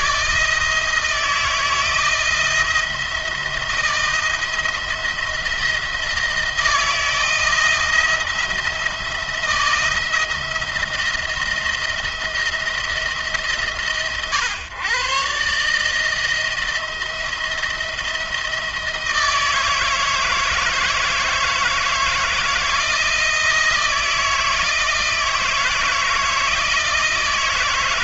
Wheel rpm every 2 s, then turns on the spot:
160, 170, 170, 170, 170, 170, 170, 110, 160, 160, 160, 170, 160, 160.
none